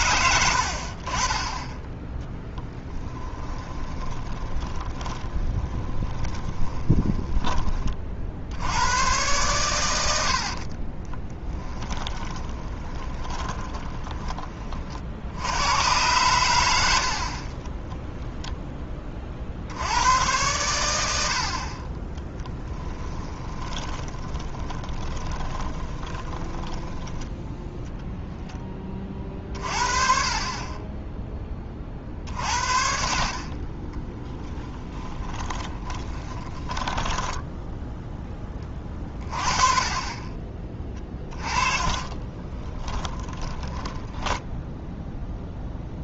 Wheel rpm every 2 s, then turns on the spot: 70, 10, 20, 20, 90, 50, 20, 50, 80, 10, 100, 10, 20, 10, 10, 20, 50, 20, 20, 20, 20, 30, 10.
2-8 10-14 22-28 34-38 42-44